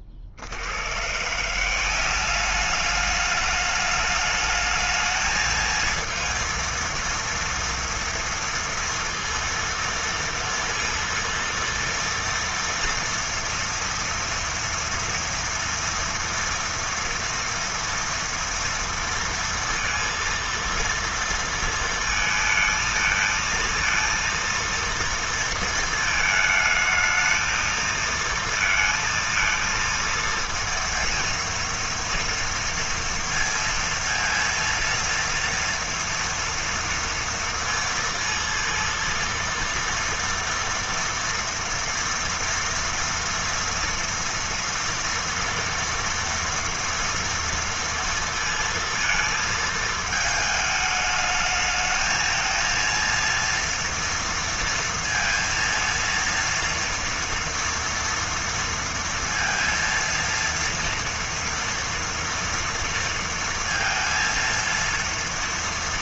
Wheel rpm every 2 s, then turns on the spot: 50, 190, 210, 230, 230, 230, 230, 230, 230, 230, 230, 220, 230, 220, 230, 230, 230, 230, 230, 230, 230, 230, 230, 230, 230, 220, 220, 230, 230, 230, 230, 230, 230.
none